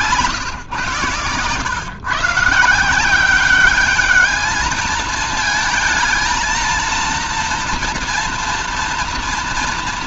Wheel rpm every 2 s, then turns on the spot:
140, 160, 210, 220, 230.
none